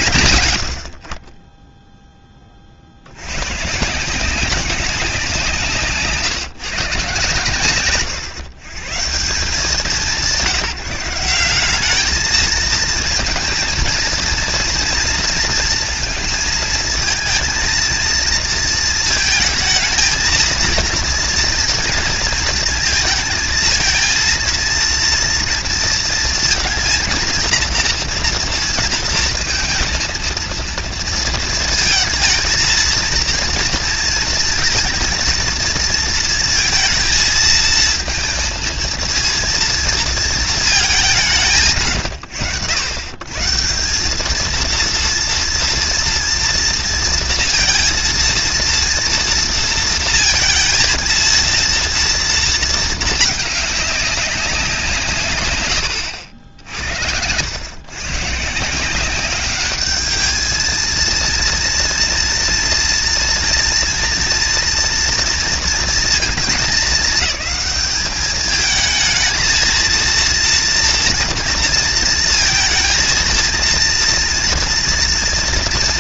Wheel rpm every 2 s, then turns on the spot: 60, 120, 170, 130, 180, 200, 230, 230, 230, 220, 230, 220, 230, 230, 230, 230, 230, 230, 230, 230, 180, 120, 230, 230, 230, 230, 220, 130, 90, 190, 230, 230, 230, 210, 220, 230, 230, 240.
none